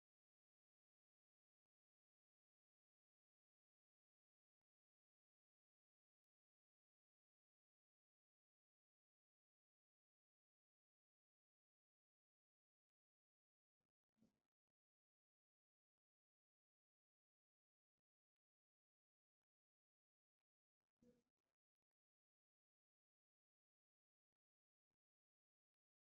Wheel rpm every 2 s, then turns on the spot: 0, 0, 0, 0, 0, 0, 0, 0, 0, 0, 0, 0, 0.
none